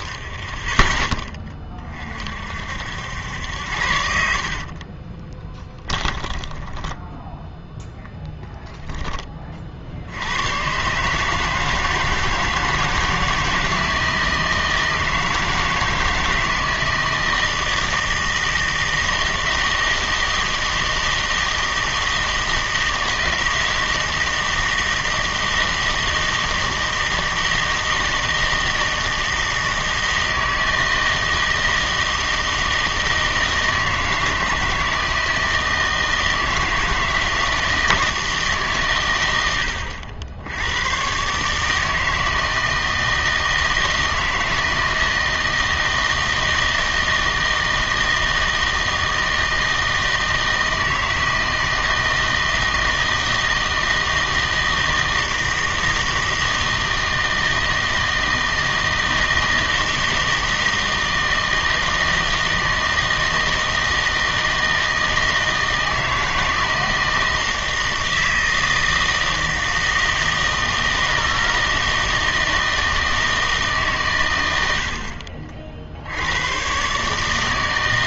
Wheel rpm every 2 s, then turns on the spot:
20, 60, 40, 10, 10, 130, 160, 160, 160, 160, 160, 160, 160, 160, 160, 160, 160, 160, 160, 140, 100, 160, 160, 160, 160, 160, 160, 160, 160, 160, 160, 160, 160, 160, 160, 160, 160, 80, 120.
4-8